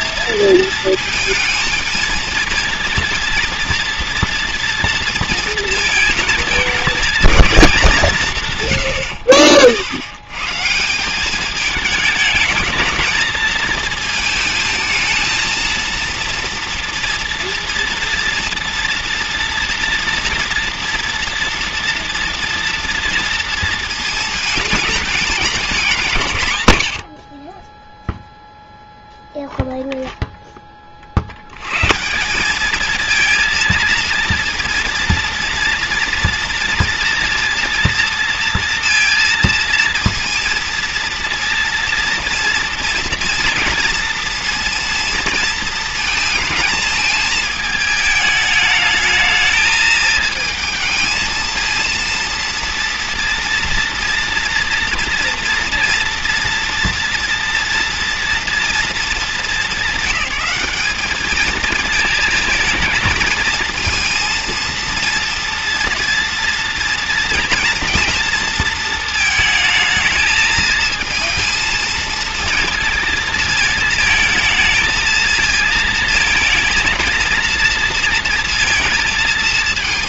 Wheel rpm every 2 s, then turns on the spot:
220, 230, 230, 220, 160, 150, 220, 220, 230, 230, 230, 240, 220, 120, 0, 20, 200, 230, 230, 230, 230, 240, 230, 220, 210, 220, 230, 230, 230, 230, 210, 220, 230, 240, 230, 220, 230, 220, 220, 230.
none